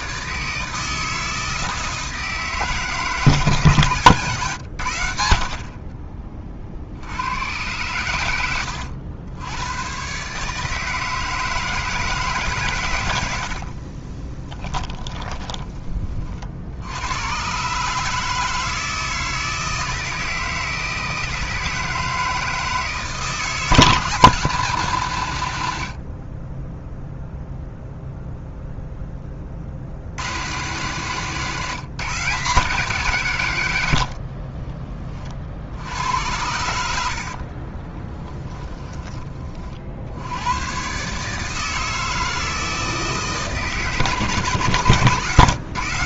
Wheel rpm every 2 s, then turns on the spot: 160, 160, 120, 40, 100, 150, 130, 20, 60, 160, 160, 160, 160, 20, 0, 120, 150, 40, 80, 10, 100, 160, 130.
8-10 14-16 26-28 34-36 38-40